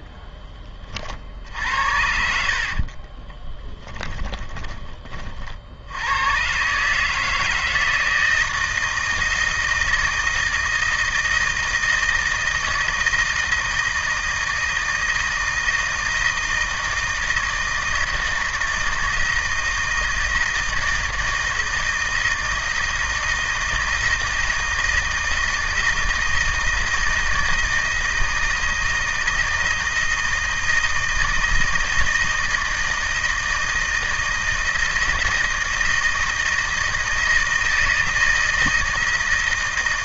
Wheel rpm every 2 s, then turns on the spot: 30, 50, 20, 140, 160, 160, 160, 160, 160, 160, 160, 160, 160, 160, 160, 160, 160, 160, 160, 160.
2-4